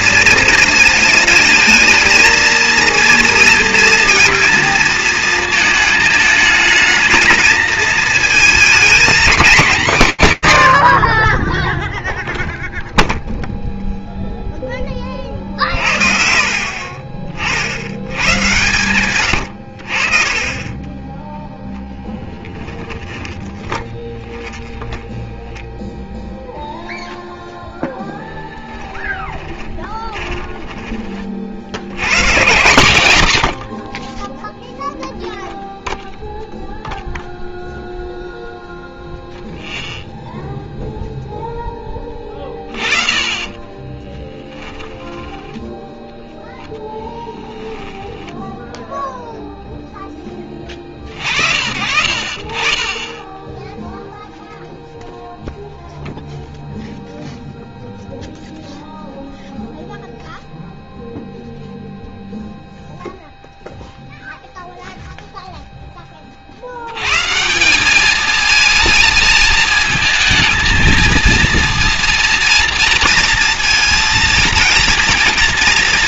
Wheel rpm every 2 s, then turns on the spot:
220, 230, 230, 220, 220, 60, 0, 10, 50, 120, 20, 10, 10, 0, 10, 30, 120, 0, 0, 0, 0, 30, 10, 10, 0, 40, 20, 0, 0, 0, 0, 0, 0, 90, 220, 230, 240, 240.
24-26 28-30 42-48